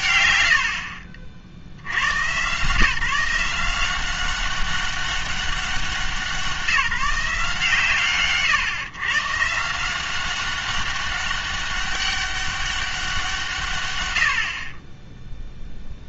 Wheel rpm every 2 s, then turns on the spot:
100, 150, 200, 180, 130, 190, 200, 40.
none